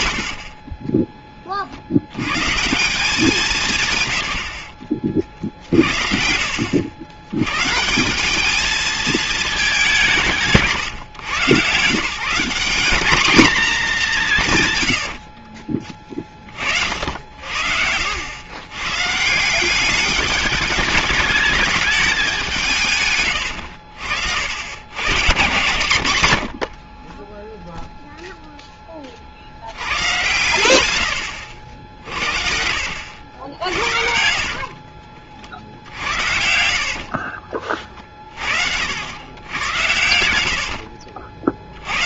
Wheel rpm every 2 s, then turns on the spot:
60, 140, 70, 70, 210, 150, 190, 130, 50, 120, 200, 190, 70, 60, 10, 110, 60, 40, 60, 60, 80.
0-2 34-38 40-42